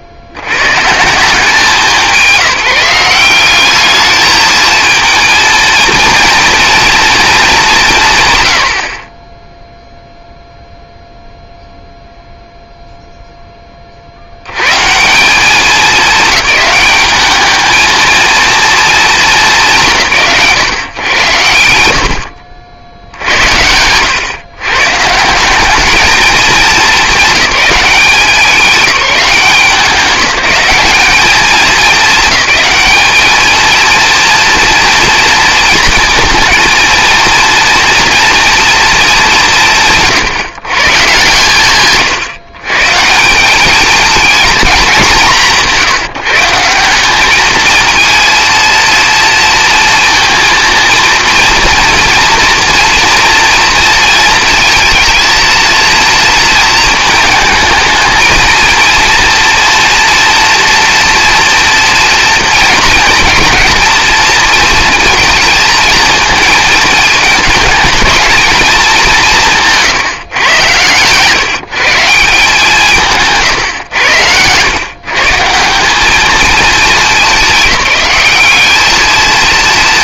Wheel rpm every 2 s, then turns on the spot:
50, 180, 220, 230, 100, 0, 0, 100, 210, 230, 130, 60, 140, 210, 180, 170, 220, 230, 230, 230, 140, 130, 210, 170, 230, 230, 230, 220, 230, 230, 240, 230, 220, 220, 220, 120, 170, 110, 210, 210.
70-72